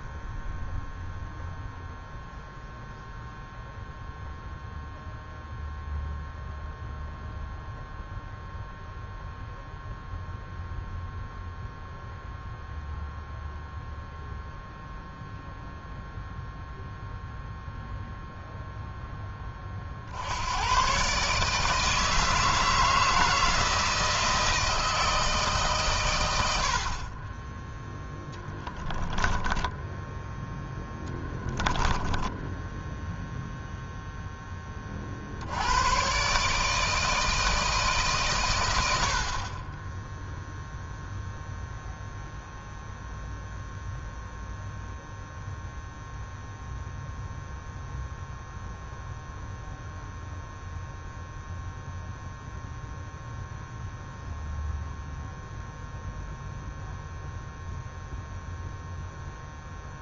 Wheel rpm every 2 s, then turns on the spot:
0, 0, 0, 0, 0, 0, 0, 0, 0, 0, 90, 160, 160, 90, 10, 10, 10, 20, 140, 100, 0, 0, 0, 0, 0, 0, 0, 0, 0, 0.
30-34